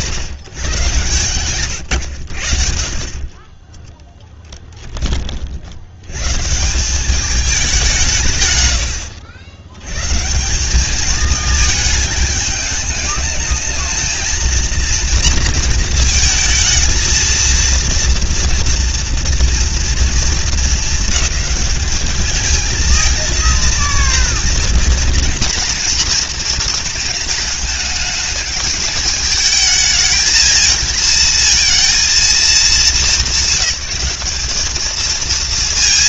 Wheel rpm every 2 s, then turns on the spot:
110, 110, 10, 160, 120, 180, 210, 230, 230, 230, 220, 220, 230, 230, 220, 220, 210, 220.
none